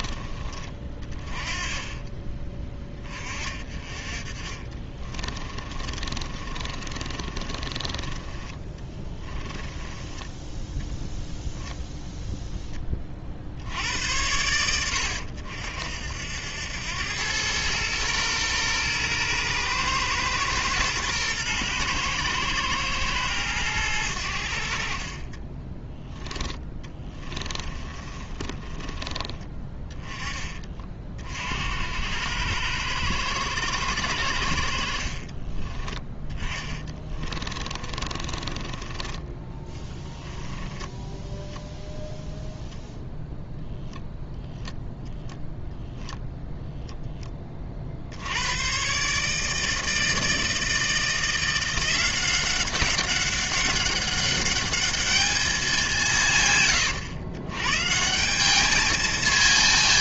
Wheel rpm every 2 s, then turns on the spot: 30, 20, 30, 30, 20, 10, 10, 90, 80, 120, 120, 120, 70, 10, 20, 30, 90, 70, 20, 30, 20, 0, 0, 0, 100, 160, 190, 200, 130, 200.
0-2 4-10 26-30 36-42